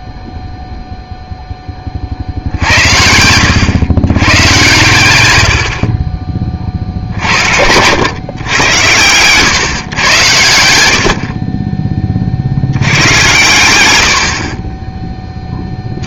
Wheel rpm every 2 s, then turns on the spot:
0, 80, 110, 50, 110, 90, 90, 30.
14-16